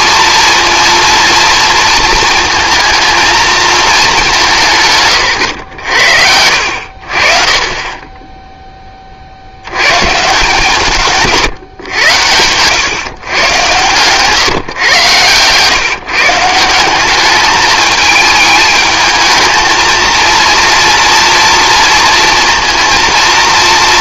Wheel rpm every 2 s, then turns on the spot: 230, 220, 170, 70, 10, 150, 120, 130, 170, 220, 230, 230.
none